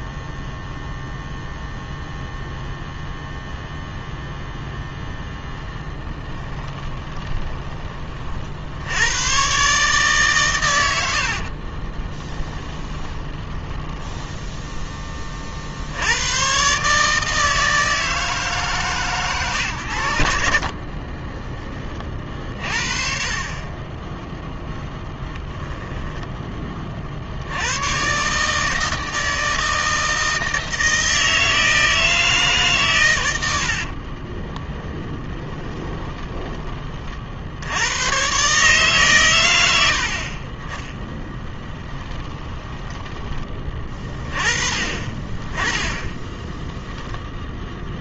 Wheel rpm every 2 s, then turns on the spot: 0, 0, 0, 10, 80, 80, 20, 10, 140, 130, 50, 50, 10, 50, 160, 160, 120, 10, 50, 130, 10, 20, 20, 0.
6-8 10-14 20-22 34-36 42-44